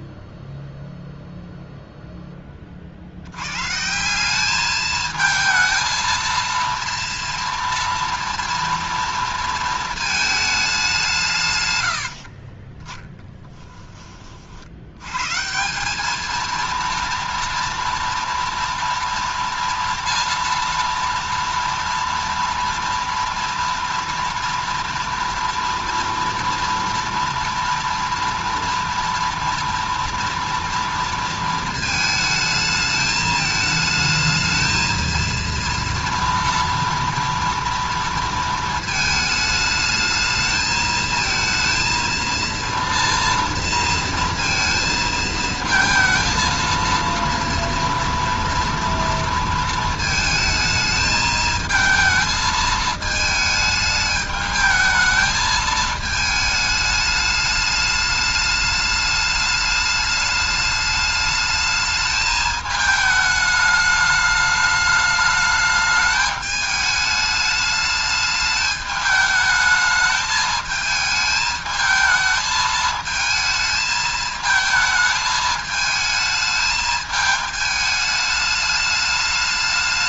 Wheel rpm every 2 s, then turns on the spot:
0, 20, 210, 230, 230, 210, 40, 60, 230, 230, 230, 230, 230, 230, 230, 230, 220, 220, 230, 220, 220, 230, 230, 230, 230, 220, 220, 220, 210, 210, 210, 220, 210, 210, 210, 220, 220, 220, 220, 210.
12-14